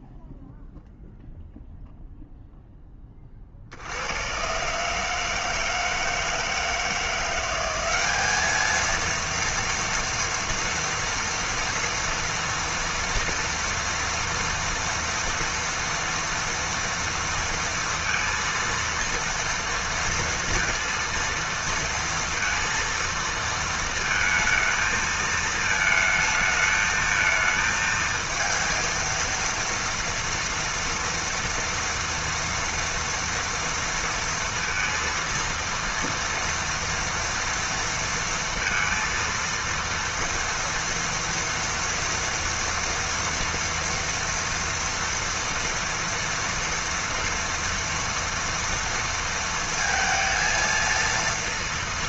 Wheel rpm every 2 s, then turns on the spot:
0, 20, 150, 170, 230, 230, 230, 230, 230, 230, 230, 230, 220, 220, 230, 230, 230, 230, 230, 230, 230, 230, 230, 230, 230, 230.
none